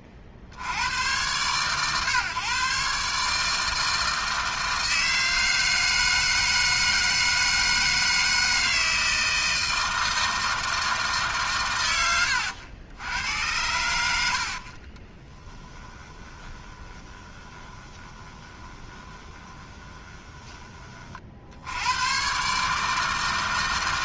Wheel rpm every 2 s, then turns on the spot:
50, 130, 160, 160, 160, 160, 80, 40, 20, 20, 20, 150.
14-20